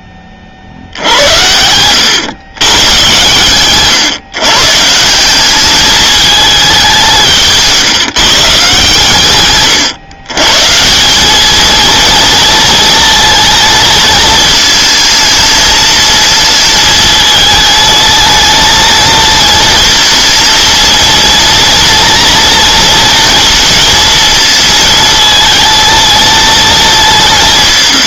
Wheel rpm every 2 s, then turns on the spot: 50, 110, 140, 210, 150, 140, 230, 220, 220, 220, 230, 230, 220, 220.
none